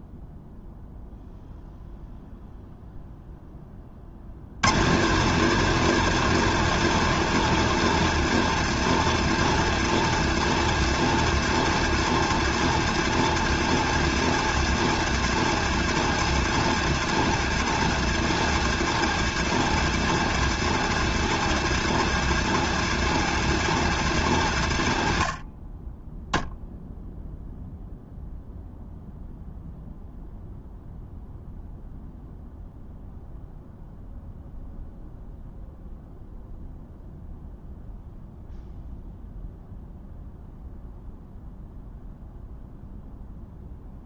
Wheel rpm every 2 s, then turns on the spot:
0, 0, 160, 220, 210, 210, 210, 210, 200, 200, 200, 210, 100, 0, 0, 0, 0, 0, 0, 0, 0, 0.
none